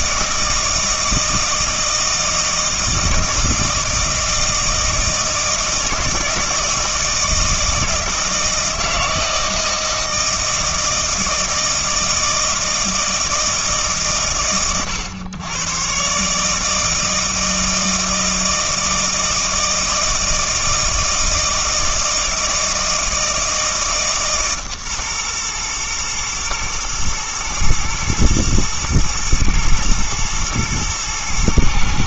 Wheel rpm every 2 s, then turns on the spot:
160, 160, 160, 160, 160, 160, 160, 90, 160, 160, 160, 160, 140, 110, 110, 120.
none